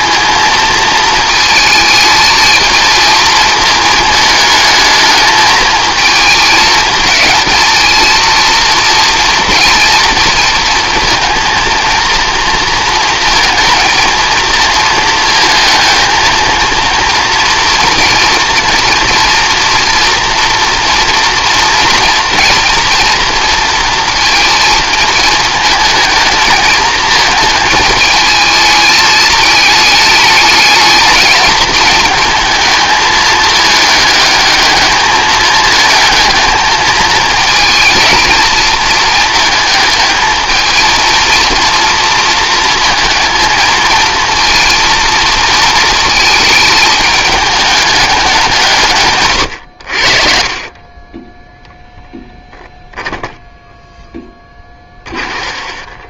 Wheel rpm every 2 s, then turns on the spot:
220, 220, 220, 210, 230, 230, 230, 230, 230, 230, 230, 230, 220, 220, 220, 220, 220, 210, 220, 230, 230, 230, 230, 220, 160, 30, 10, 20.
52-56